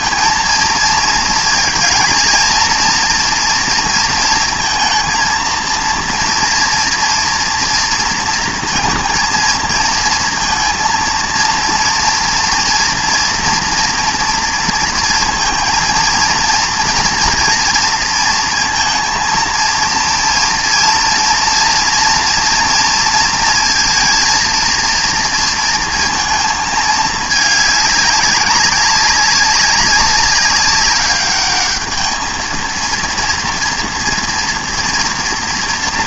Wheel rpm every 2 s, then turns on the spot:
230, 230, 230, 230, 230, 230, 230, 230, 230, 230, 230, 230, 230, 220, 200, 200, 220, 230.
none